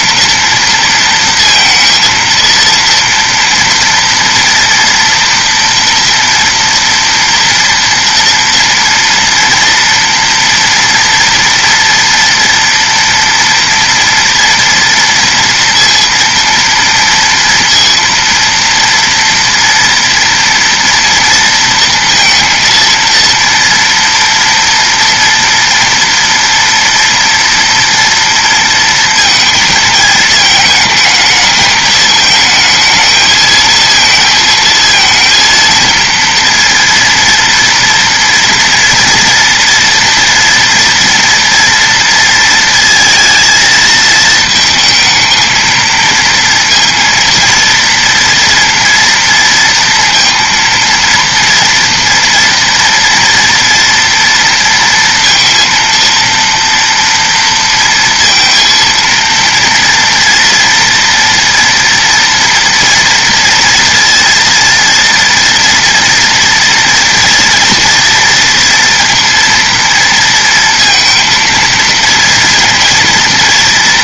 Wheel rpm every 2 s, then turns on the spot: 230, 230, 230, 230, 230, 230, 230, 230, 230, 230, 230, 230, 240, 230, 230, 220, 220, 220, 230, 230, 230, 230, 220, 230, 230, 230, 230, 230, 230, 230, 230, 230, 230, 230, 230, 230, 230.
none